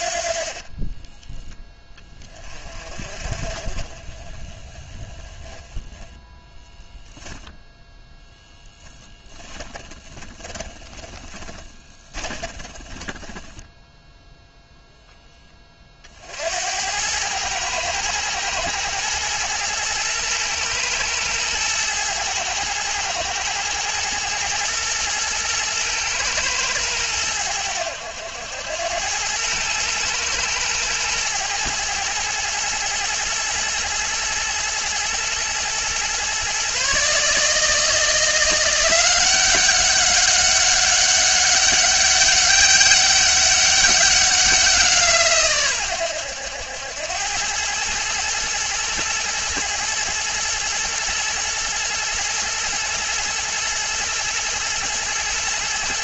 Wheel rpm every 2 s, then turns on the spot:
20, 30, 20, 0, 10, 20, 20, 0, 100, 120, 110, 110, 120, 100, 100, 110, 120, 120, 140, 180, 200, 200, 160, 100, 120, 110, 120, 120.
0-2 8-14